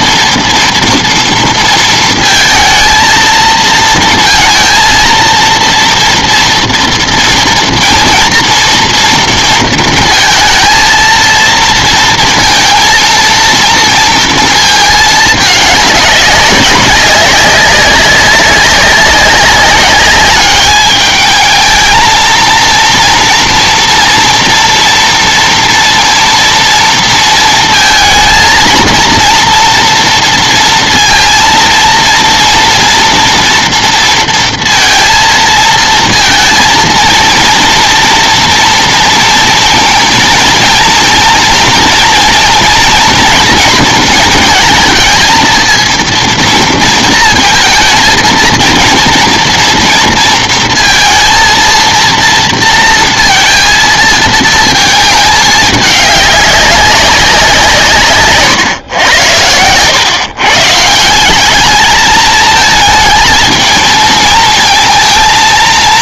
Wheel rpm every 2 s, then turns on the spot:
230, 230, 230, 230, 230, 230, 230, 220, 200, 190, 210, 230, 230, 230, 230, 230, 230, 230, 230, 230, 230, 240, 220, 230, 230, 230, 230, 220, 200, 130, 140, 220, 220.
none